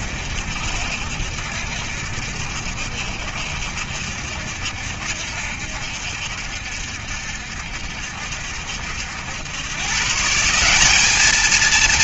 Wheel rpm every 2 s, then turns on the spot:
70, 70, 70, 70, 70, 200.
none